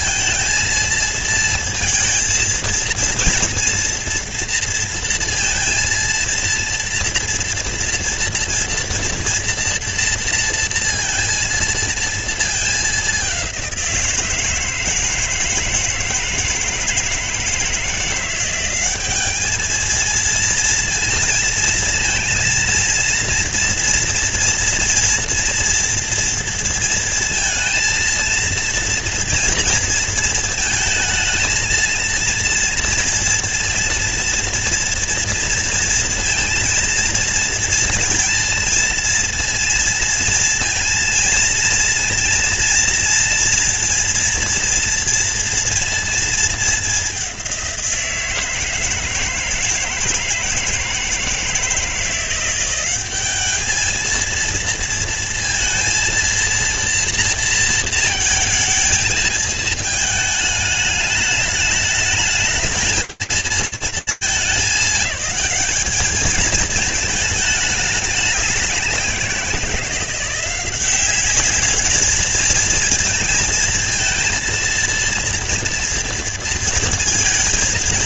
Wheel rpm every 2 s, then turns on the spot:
230, 230, 230, 230, 230, 230, 230, 170, 160, 170, 230, 230, 240, 230, 230, 230, 230, 230, 230, 230, 230, 230, 230, 230, 170, 160, 170, 220, 230, 230, 210, 210, 210, 210, 200, 180, 220, 230, 230.
none